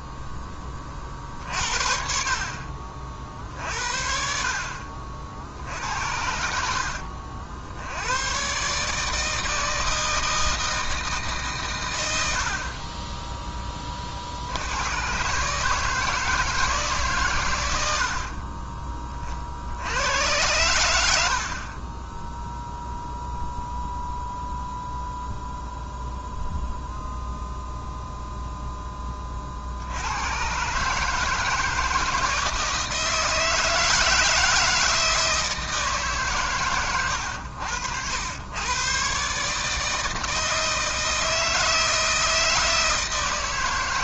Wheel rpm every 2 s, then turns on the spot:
30, 50, 60, 70, 150, 160, 30, 90, 150, 30, 80, 0, 0, 0, 10, 140, 160, 160, 110, 130, 160, 160.
none